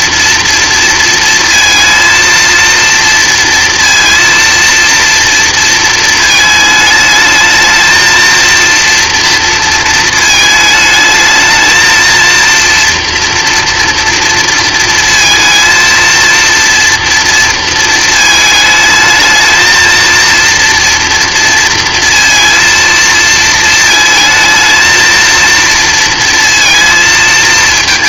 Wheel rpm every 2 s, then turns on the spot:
230, 230, 230, 210, 230, 220, 230, 230, 230, 220, 230, 230, 220, 230.
none